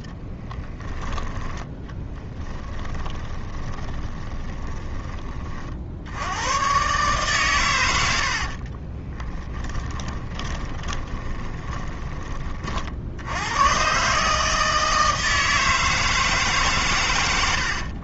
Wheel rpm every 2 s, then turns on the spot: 10, 10, 20, 130, 40, 20, 40, 160, 140.
2-4 8-12